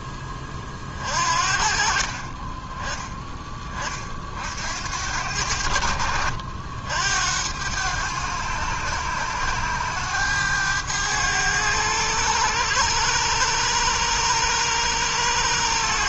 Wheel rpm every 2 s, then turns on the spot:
20, 30, 60, 60, 100, 100, 100, 100.
none